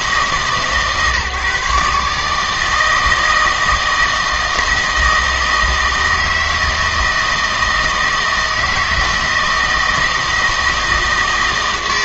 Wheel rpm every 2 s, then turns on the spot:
150, 160, 160, 160, 160, 160.
none